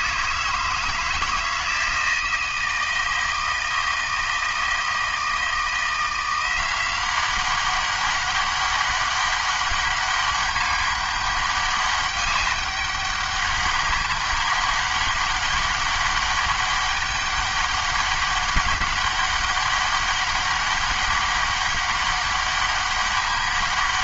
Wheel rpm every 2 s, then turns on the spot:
160, 160, 160, 180, 200, 200, 200, 200, 200, 200, 200, 200.
none